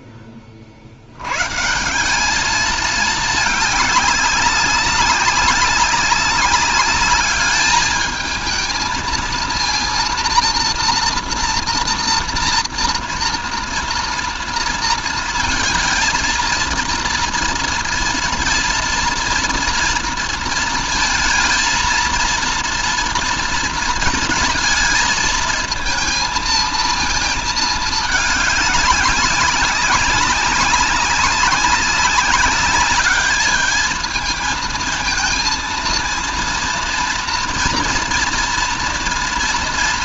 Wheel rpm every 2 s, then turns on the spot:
30, 210, 200, 200, 220, 230, 230, 230, 230, 230, 230, 230, 220, 230, 210, 200, 200, 220, 230, 230.
none